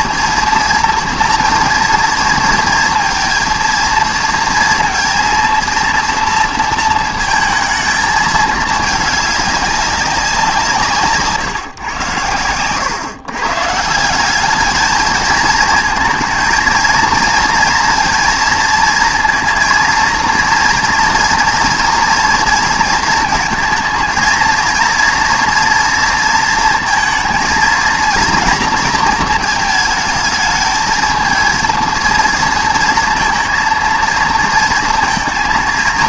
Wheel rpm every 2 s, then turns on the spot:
230, 230, 230, 230, 210, 170, 120, 210, 230, 230, 230, 230, 230, 230, 230, 220, 230, 230.
none